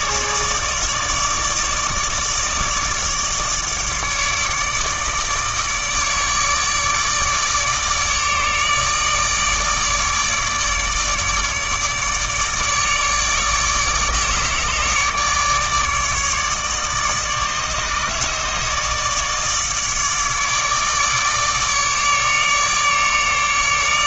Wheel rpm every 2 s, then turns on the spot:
150, 150, 150, 150, 150, 150, 150, 150, 150, 150, 150, 150.
none